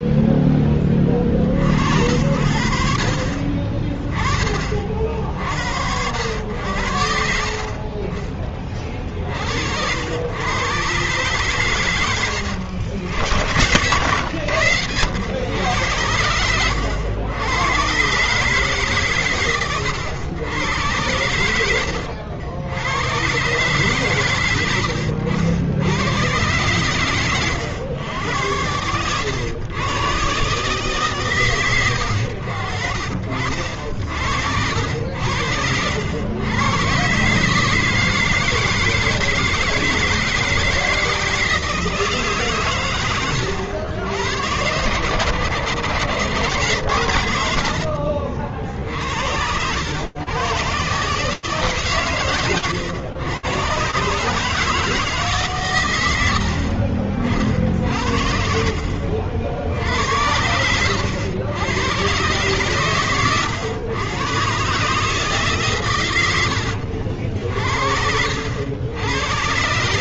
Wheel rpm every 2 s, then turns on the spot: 0, 60, 30, 70, 40, 70, 110, 90, 100, 120, 120, 90, 130, 100, 110, 130, 110, 50, 90, 160, 160, 160, 100, 110, 70, 90, 140, 130, 90, 70, 80, 120, 120, 110, 70.
56-58 60-62